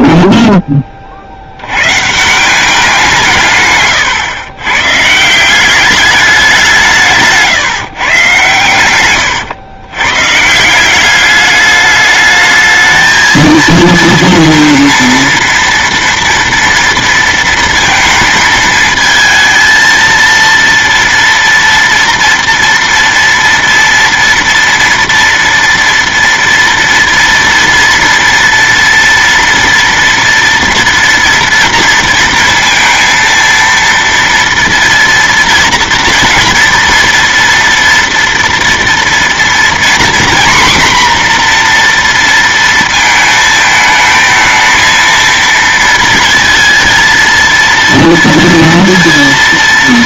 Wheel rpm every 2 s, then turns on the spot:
10, 190, 120, 180, 120, 160, 220, 230, 230, 220, 230, 230, 230, 230, 230, 230, 230, 230, 230, 230, 250, 230, 220, 230, 230.
none